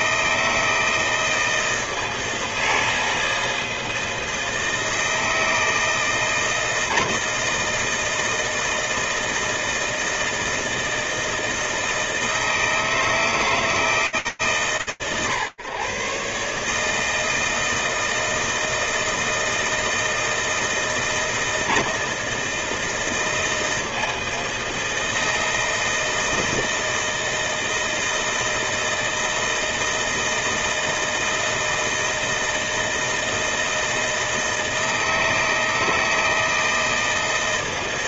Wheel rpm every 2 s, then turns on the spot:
160, 160, 160, 160, 160, 160, 160, 130, 160, 160, 160, 160, 160, 160, 160, 160, 160, 160, 160.
none